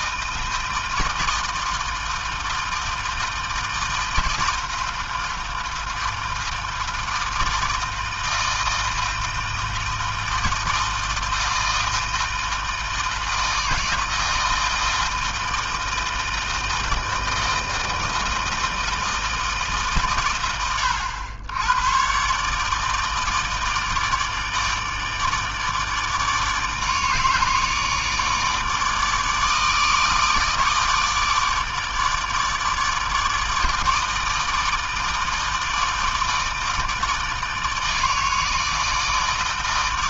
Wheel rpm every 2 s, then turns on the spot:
160, 160, 160, 160, 160, 160, 160, 160, 160, 160, 90, 150, 150, 160, 160, 160, 160, 160, 160, 160.
none